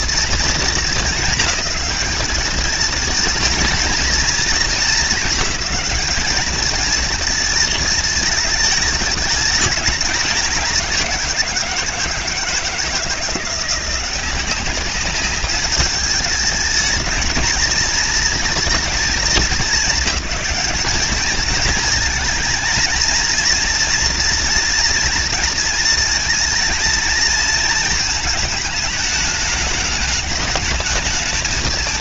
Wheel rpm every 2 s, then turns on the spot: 220, 220, 230, 220, 210, 180, 170, 200, 220, 220, 210, 230, 230, 220, 220, 220.
none